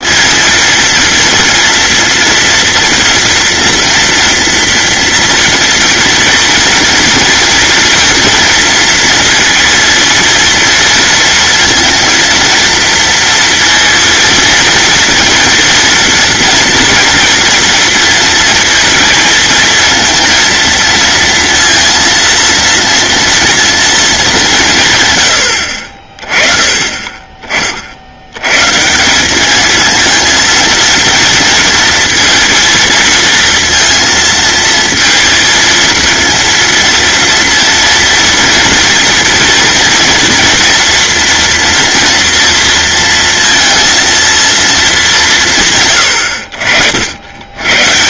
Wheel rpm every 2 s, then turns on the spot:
230, 230, 230, 230, 230, 230, 230, 230, 230, 230, 230, 230, 140, 30, 150, 230, 230, 230, 230, 230, 230, 230, 220, 70.
none